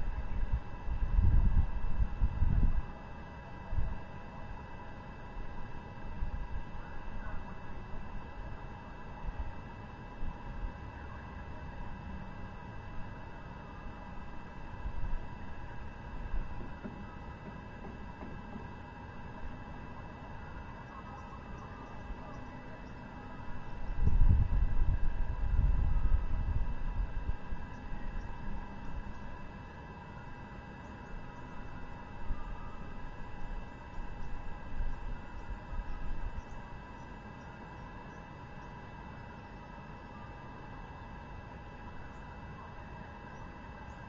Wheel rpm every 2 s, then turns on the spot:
0, 0, 0, 0, 0, 0, 0, 0, 0, 0, 0, 0, 0, 0, 0, 0, 0, 0, 0, 0, 0, 0.
none